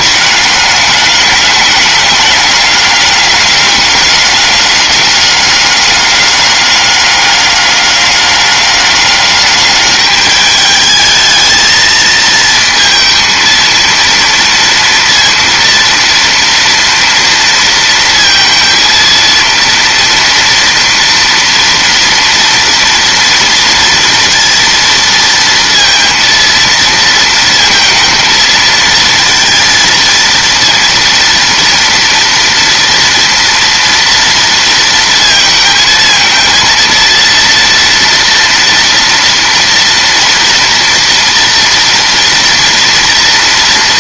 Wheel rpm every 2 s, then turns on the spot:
210, 200, 200, 200, 200, 210, 220, 230, 230, 230, 230, 230, 230, 230, 230, 230, 230, 230, 220, 230, 240, 230.
none